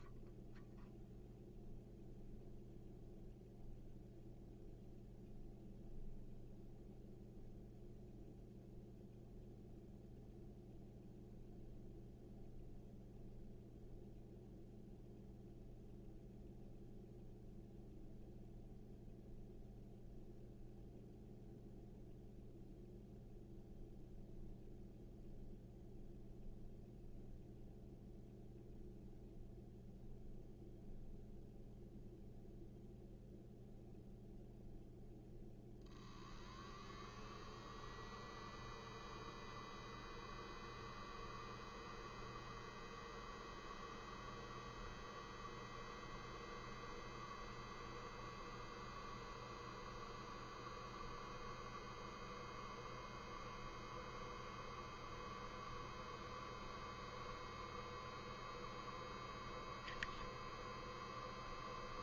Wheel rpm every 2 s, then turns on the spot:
0, 0, 0, 0, 0, 0, 0, 0, 0, 0, 0, 0, 0, 0, 0, 0, 0, 0, 0, 0, 0, 0, 0, 0, 0, 0, 0, 0, 0, 0, 0.
none